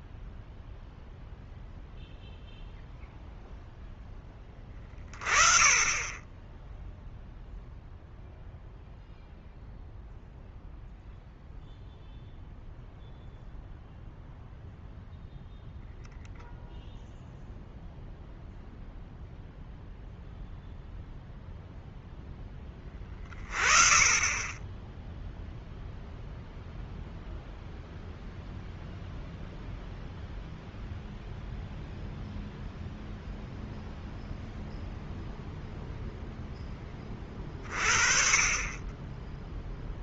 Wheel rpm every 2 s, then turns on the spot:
0, 0, 20, 0, 0, 0, 0, 0, 0, 0, 0, 10, 10, 0, 0, 0, 0, 0, 20, 30.
none